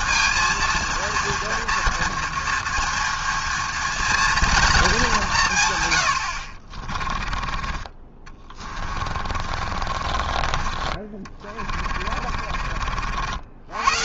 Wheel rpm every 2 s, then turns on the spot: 230, 230, 210, 50, 30, 30, 40.
6-10